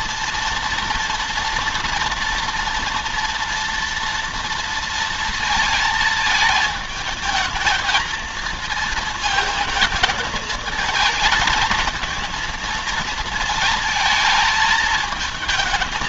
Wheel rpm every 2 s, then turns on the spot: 230, 230, 230, 220, 220, 220, 220, 220.
none